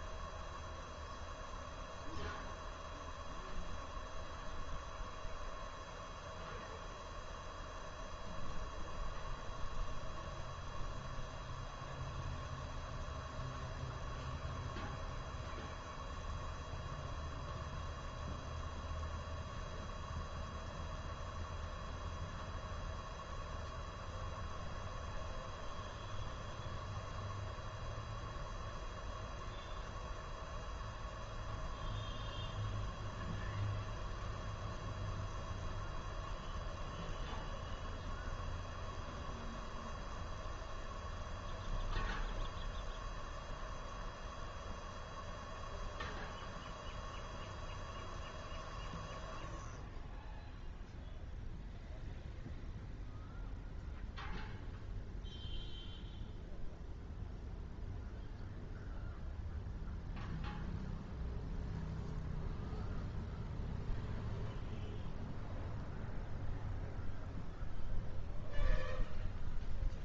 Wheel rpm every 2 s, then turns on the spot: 0, 0, 0, 0, 0, 0, 0, 0, 0, 0, 0, 0, 0, 0, 0, 0, 0, 0, 0, 0, 0, 0, 0, 0, 0, 0, 0, 0, 0, 0, 0, 0, 0, 0, 0.
none